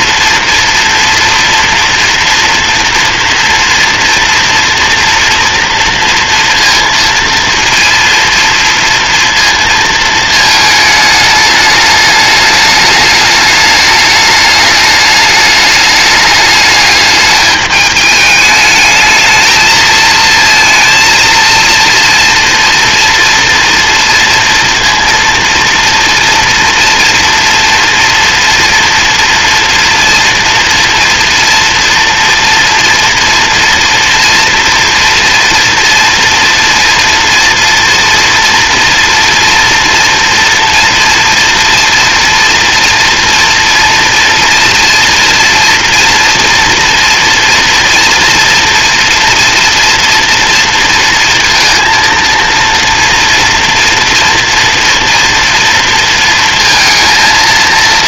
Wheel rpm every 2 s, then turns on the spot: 240, 230, 230, 230, 230, 210, 210, 210, 210, 220, 230, 230, 230, 230, 230, 240, 230, 230, 230, 230, 230, 230, 230, 230, 230, 230, 230, 230, 230.
none